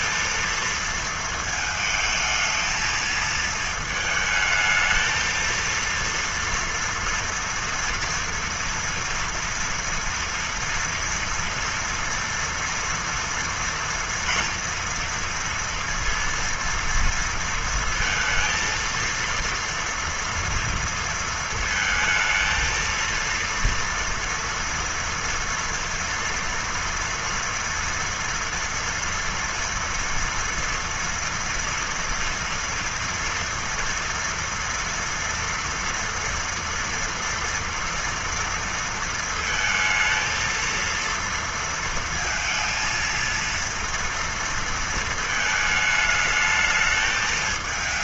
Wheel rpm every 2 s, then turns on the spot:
220, 220, 220, 230, 240, 230, 230, 230, 230, 230, 230, 230, 230, 230, 240, 240, 230, 230, 230, 230, 230, 230, 230, 220.
none